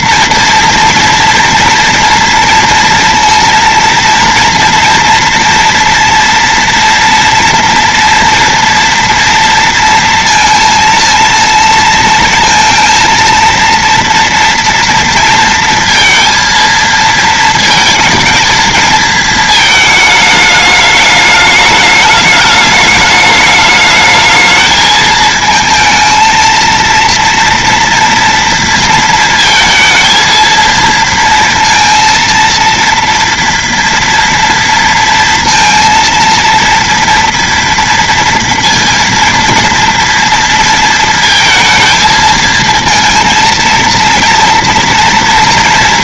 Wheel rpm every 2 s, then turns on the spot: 230, 230, 230, 230, 230, 230, 230, 230, 230, 220, 220, 210, 220, 230, 230, 230, 230, 230, 230, 230, 230, 230, 230.
none